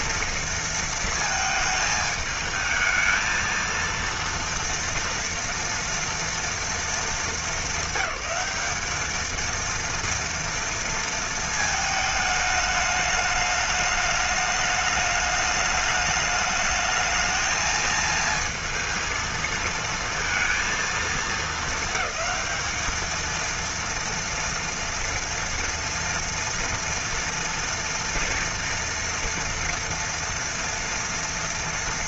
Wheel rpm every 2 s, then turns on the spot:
230, 220, 230, 230, 200, 230, 210, 210, 220, 230, 230, 220, 230, 230, 230, 230.
none